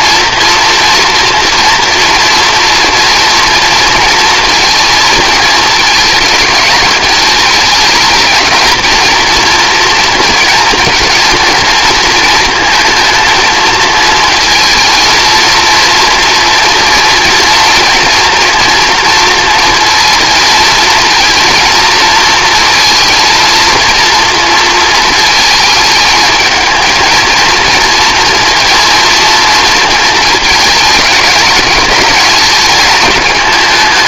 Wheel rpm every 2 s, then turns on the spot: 230, 230, 220, 220, 230, 230, 230, 230, 230, 230, 230, 230, 220, 230, 230, 210, 210.
none